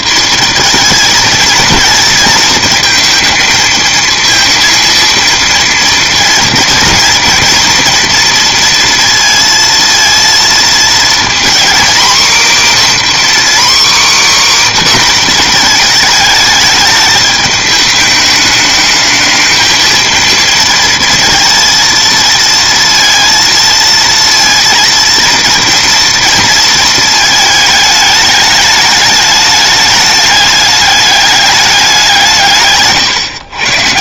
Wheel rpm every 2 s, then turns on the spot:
230, 230, 230, 230, 230, 230, 270, 270, 210, 210, 230, 230, 230, 220, 210, 210, 140.
none